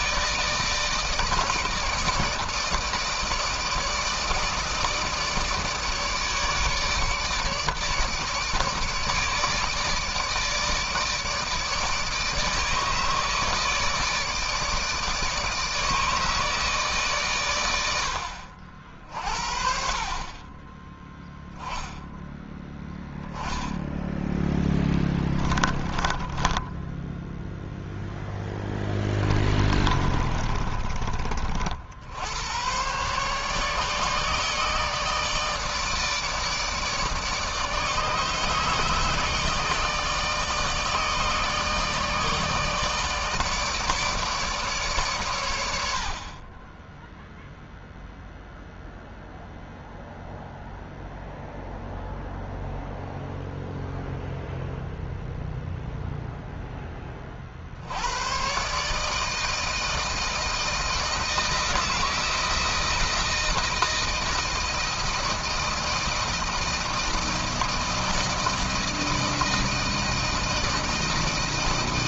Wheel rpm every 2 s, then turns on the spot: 160, 160, 160, 150, 150, 160, 160, 160, 140, 50, 10, 10, 10, 10, 20, 30, 130, 160, 160, 160, 150, 150, 140, 10, 0, 0, 0, 0, 20, 150, 160, 160, 160, 160, 160, 160.
24-26 28-30